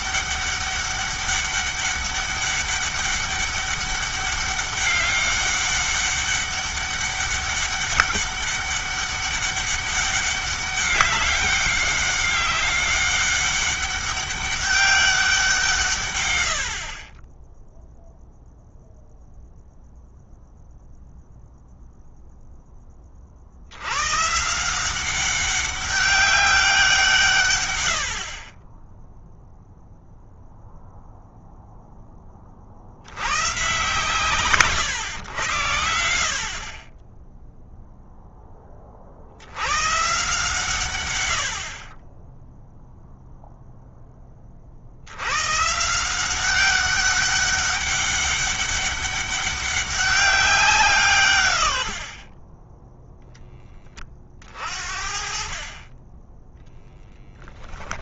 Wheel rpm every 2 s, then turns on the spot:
200, 200, 200, 200, 200, 200, 200, 190, 30, 0, 0, 20, 190, 170, 10, 0, 40, 110, 30, 40, 120, 0, 80, 200, 200, 160, 10, 50, 10.
52-54